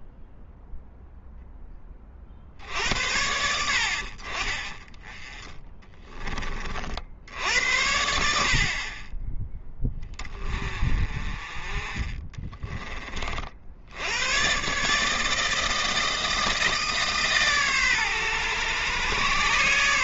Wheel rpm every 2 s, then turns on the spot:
0, 70, 20, 40, 50, 30, 20, 130, 160, 120.
none